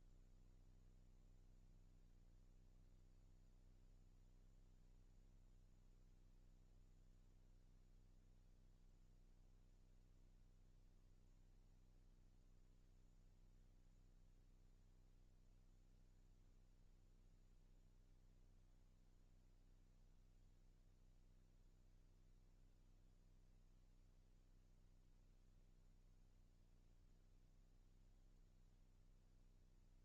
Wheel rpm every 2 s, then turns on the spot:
0, 0, 0, 0, 0, 0, 0, 0, 0, 0, 0, 0, 0, 0, 0.
none